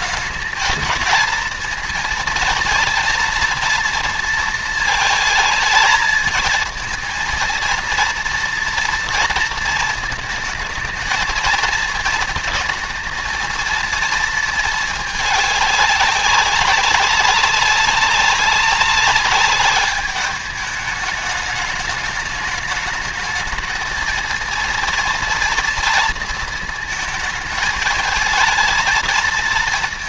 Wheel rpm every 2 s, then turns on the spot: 230, 230, 220, 220, 230, 220, 220, 220, 190, 200, 210, 220, 230, 220, 220.
none